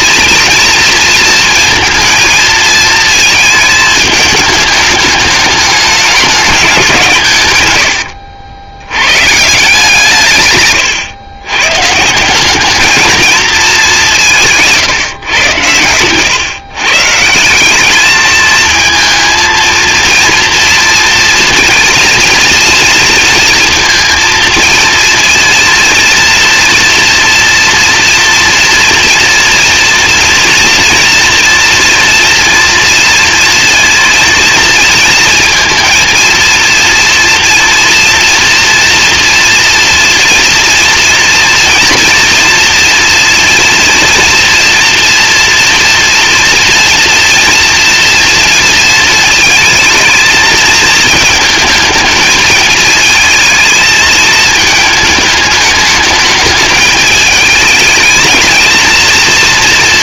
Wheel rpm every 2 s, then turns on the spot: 230, 230, 210, 190, 90, 130, 220, 140, 140, 220, 230, 230, 230, 240, 230, 230, 230, 230, 230, 230, 240, 230, 240, 230, 230, 230, 220, 220, 220, 230.
none